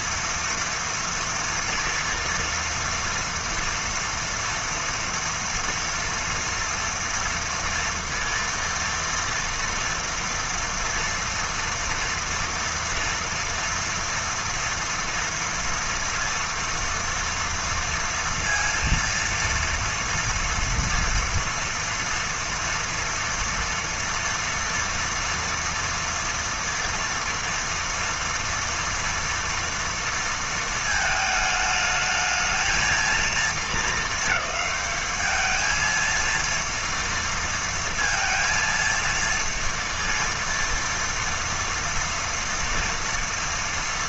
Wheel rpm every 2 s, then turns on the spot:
230, 230, 230, 230, 230, 230, 230, 230, 230, 230, 240, 230, 230, 230, 230, 220, 230, 210, 230, 230, 230, 230.
none